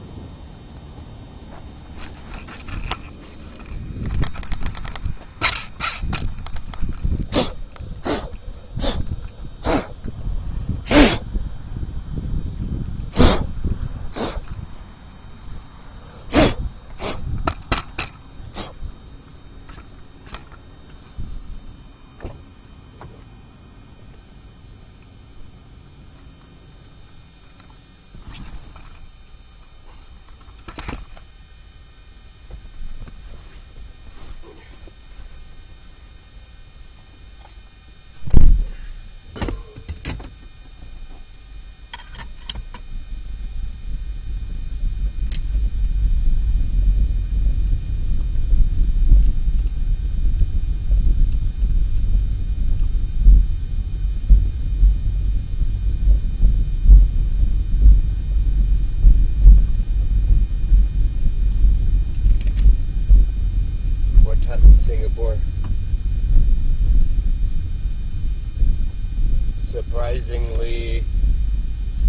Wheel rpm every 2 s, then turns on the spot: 0, 0, 0, 0, 0, 0, 0, 0, 0, 0, 0, 0, 0, 0, 0, 0, 0, 0, 0, 0, 0, 0, 0, 0, 0, 0, 0, 0, 0, 0, 0, 0, 0, 0, 0, 0.
none